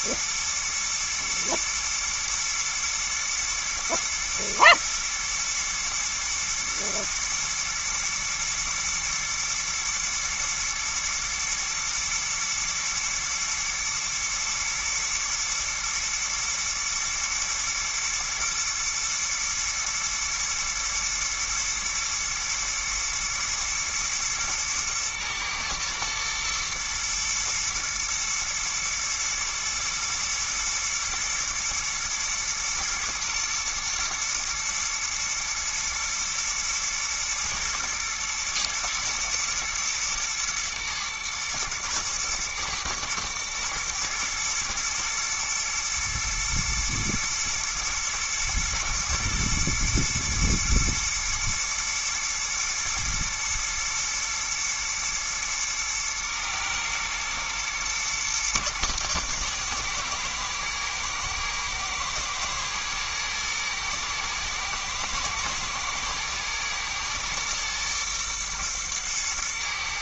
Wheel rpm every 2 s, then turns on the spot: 120, 110, 110, 120, 120, 120, 120, 110, 110, 120, 110, 110, 110, 120, 110, 110, 110, 110, 110, 120, 110, 110, 110, 110, 110, 110, 120, 110, 110, 110, 120, 120, 110, 120, 120.
none